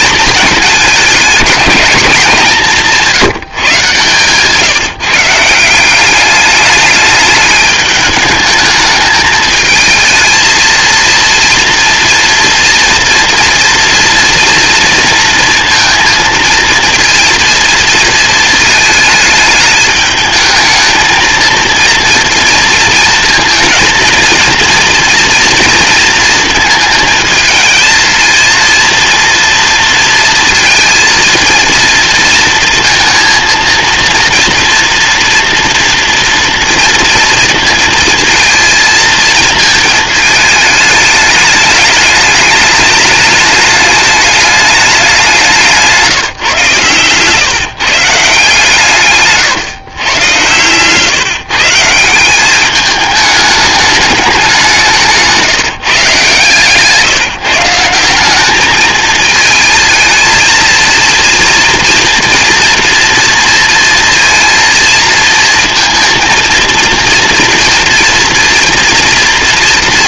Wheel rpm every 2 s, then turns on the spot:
210, 170, 150, 210, 210, 220, 230, 230, 230, 230, 220, 230, 230, 220, 230, 230, 230, 230, 230, 220, 210, 210, 210, 130, 150, 130, 200, 190, 140, 200, 220, 230, 230, 230, 230.
none